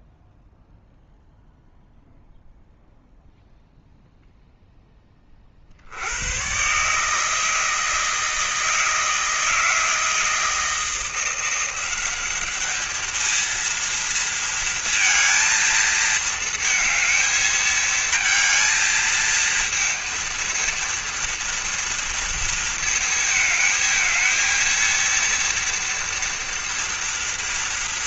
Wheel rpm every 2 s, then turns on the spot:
0, 0, 10, 130, 170, 170, 210, 230, 220, 220, 230, 230, 230, 230.
none